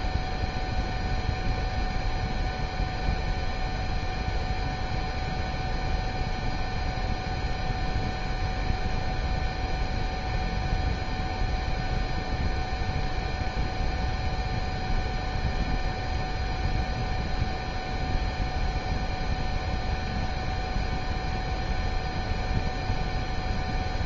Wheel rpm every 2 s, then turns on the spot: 0, 0, 0, 0, 0, 0, 0, 0, 0, 0, 0, 0.
none